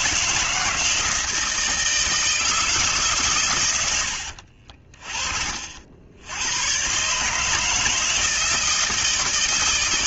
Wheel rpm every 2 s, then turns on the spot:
160, 150, 40, 120, 160.
none